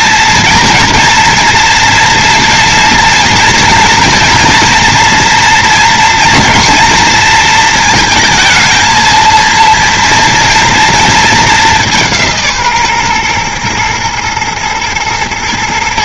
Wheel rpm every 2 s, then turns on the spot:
230, 230, 230, 230, 230, 230, 140, 110.
none